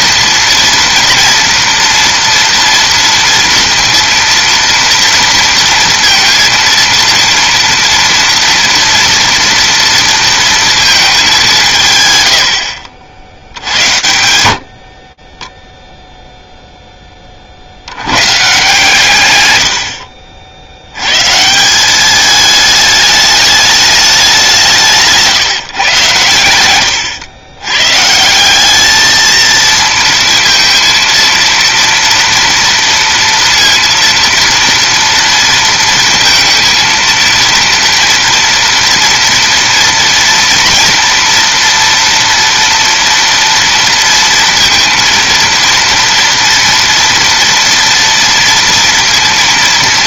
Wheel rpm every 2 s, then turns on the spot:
240, 230, 230, 230, 240, 230, 80, 80, 10, 150, 80, 210, 170, 110, 200, 230, 230, 230, 230, 230, 240, 230, 230, 240, 230.
none